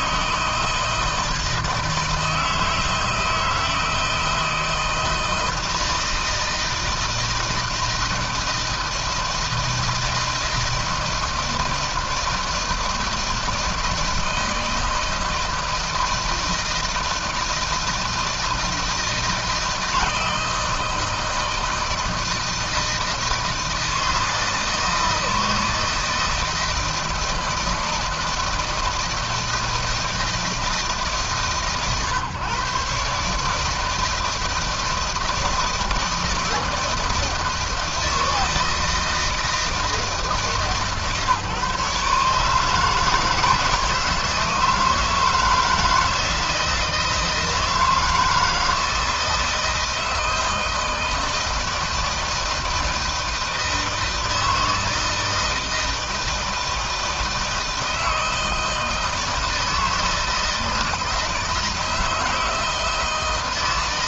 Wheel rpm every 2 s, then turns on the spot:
160, 160, 160, 160, 160, 160, 160, 160, 160, 160, 160, 160, 160, 160, 160, 150, 140, 160, 160, 160, 150, 160, 160, 160, 160, 160, 160, 160, 160, 160, 160, 160.
none